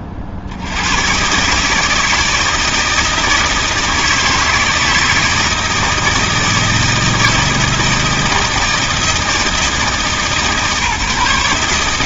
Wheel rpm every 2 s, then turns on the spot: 80, 160, 160, 160, 160, 140.
none